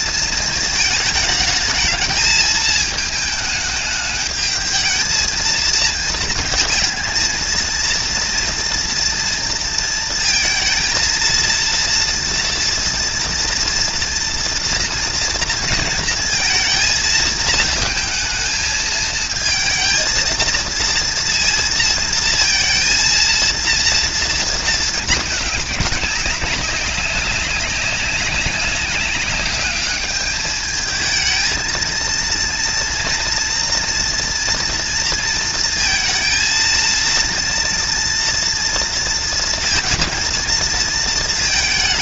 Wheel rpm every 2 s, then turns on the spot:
220, 220, 220, 230, 230, 230, 240, 230, 230, 220, 230, 230, 230, 200, 190, 210, 230, 240, 220, 230, 230.
none